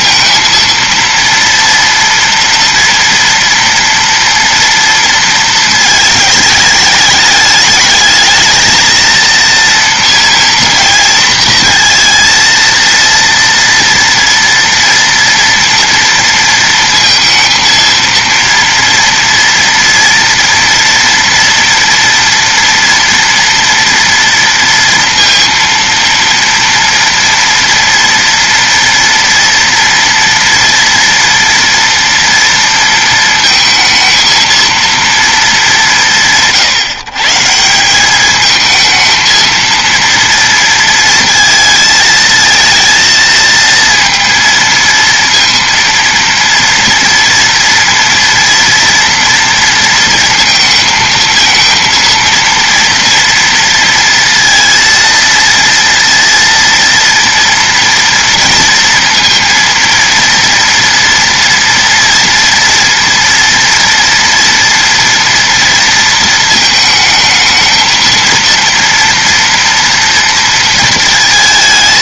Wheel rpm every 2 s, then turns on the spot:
230, 230, 230, 210, 220, 230, 230, 230, 230, 230, 240, 230, 230, 230, 230, 240, 230, 230, 160, 220, 230, 220, 230, 230, 230, 220, 230, 230, 230, 230, 230, 240, 230, 220, 230, 230.
none